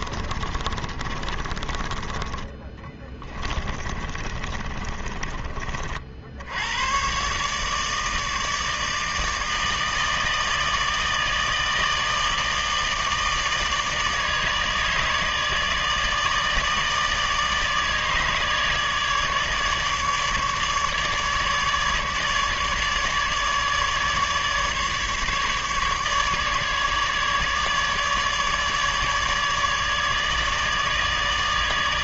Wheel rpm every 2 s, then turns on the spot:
30, 20, 30, 90, 160, 160, 160, 150, 150, 150, 150, 150, 150, 150, 150, 150.
0-6